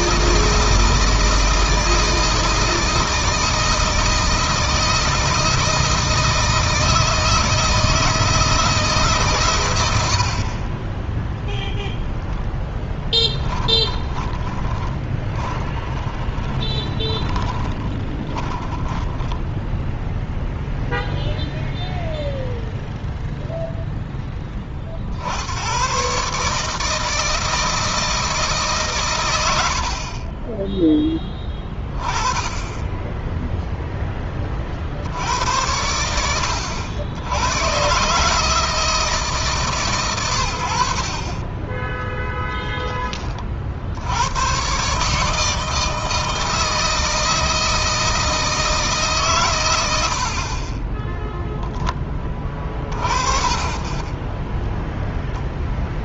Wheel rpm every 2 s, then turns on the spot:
160, 160, 160, 160, 160, 20, 10, 10, 20, 10, 0, 0, 40, 150, 140, 10, 10, 60, 90, 160, 70, 20, 130, 160, 150, 30, 40, 10.
12-18 50-52 54-56